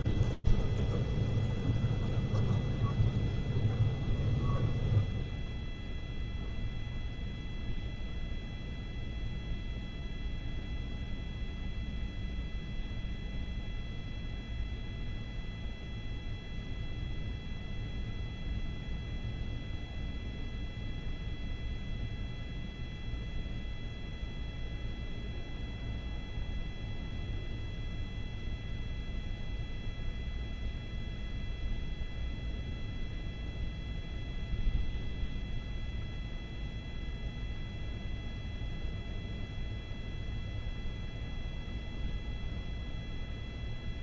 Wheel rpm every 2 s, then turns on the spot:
0, 0, 0, 0, 0, 0, 0, 0, 0, 0, 0, 0, 0, 0, 0, 0, 0, 0, 0, 0, 0, 0.
none